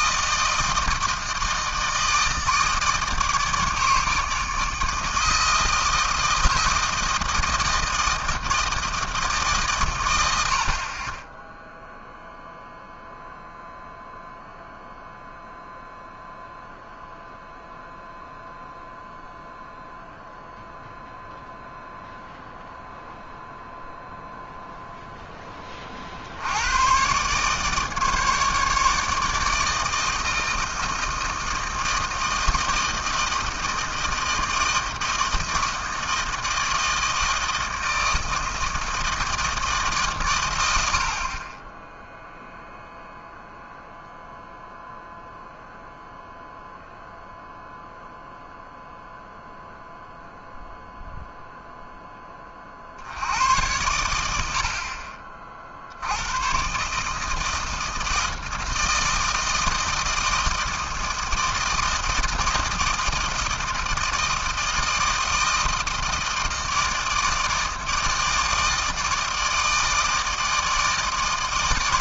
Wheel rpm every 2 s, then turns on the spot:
160, 160, 160, 160, 160, 60, 0, 0, 0, 0, 0, 0, 0, 90, 150, 160, 160, 160, 160, 160, 90, 0, 0, 0, 0, 0, 40, 70, 120, 160, 160, 160, 160, 160, 160, 160.
none